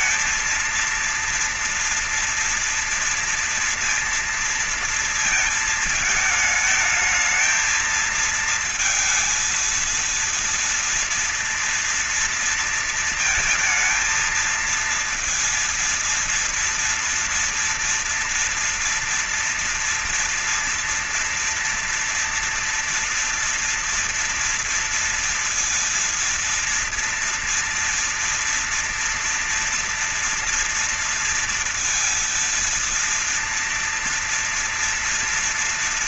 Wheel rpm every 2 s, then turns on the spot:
230, 230, 230, 220, 230, 230, 230, 230, 230, 230, 230, 230, 230, 230, 230, 230, 230, 240.
none